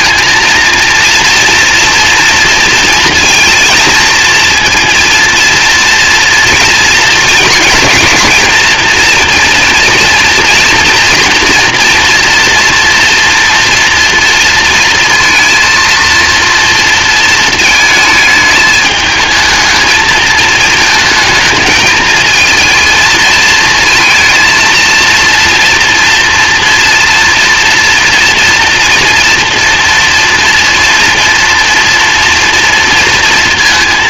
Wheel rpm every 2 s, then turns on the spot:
230, 230, 230, 230, 230, 240, 230, 230, 230, 220, 220, 220, 230, 230, 230, 230, 230.
none